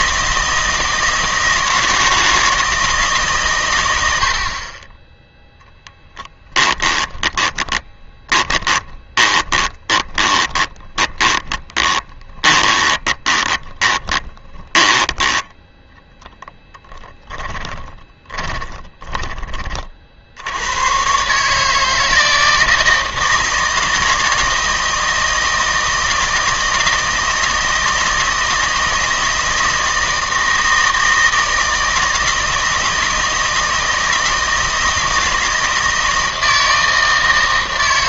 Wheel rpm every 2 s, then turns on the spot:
160, 160, 30, 10, 20, 20, 20, 10, 10, 20, 90, 160, 160, 160, 160, 160, 160, 160, 160.
6-20